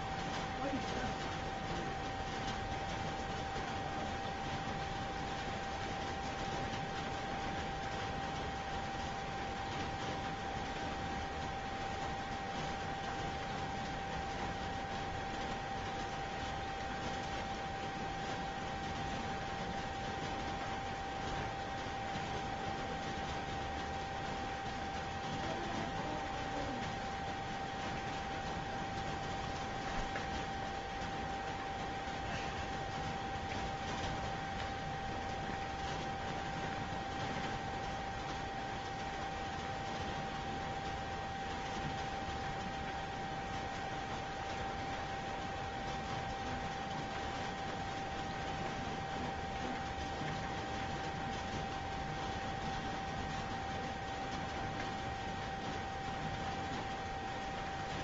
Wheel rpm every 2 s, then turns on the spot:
0, 0, 0, 0, 0, 0, 0, 0, 0, 0, 0, 0, 0, 0, 0, 0, 0, 0, 0, 0, 0, 0, 0, 0, 0, 0, 0, 0, 0.
none